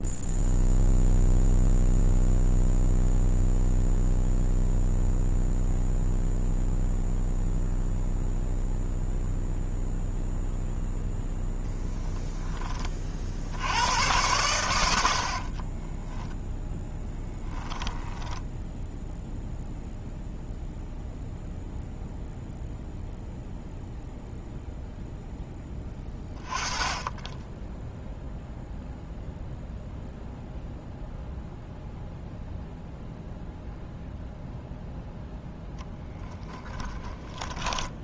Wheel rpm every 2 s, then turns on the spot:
0, 0, 0, 0, 0, 0, 20, 90, 0, 10, 0, 0, 0, 30, 0, 0, 0, 0, 10.
18-20 36-38